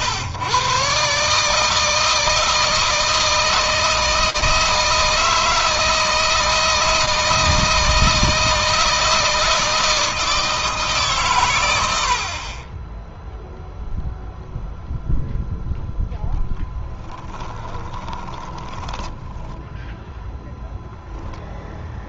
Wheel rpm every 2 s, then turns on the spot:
120, 160, 160, 160, 160, 160, 50, 0, 10, 10, 0.
18-20